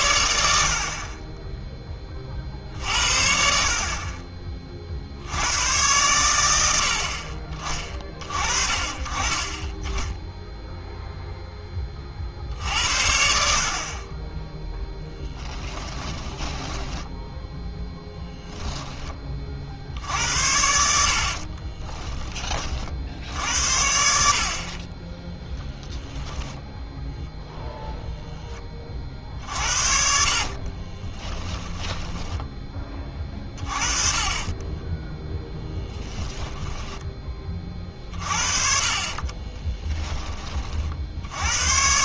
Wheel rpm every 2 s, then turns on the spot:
60, 60, 40, 80, 40, 0, 70, 10, 10, 10, 70, 40, 40, 0, 30, 30, 20, 20, 10, 40, 30.
14-18 30-32 34-38